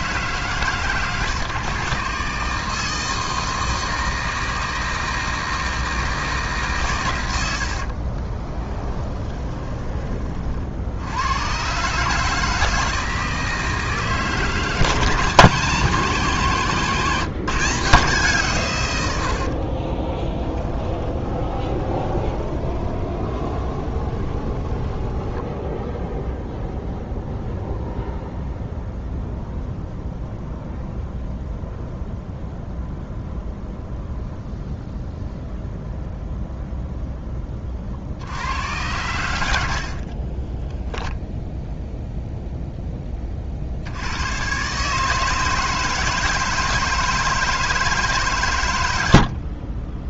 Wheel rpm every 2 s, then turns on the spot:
150, 150, 160, 140, 20, 60, 160, 160, 160, 130, 20, 20, 20, 0, 0, 0, 0, 0, 0, 80, 10, 10, 130, 160, 120.
8-10 20-26 40-42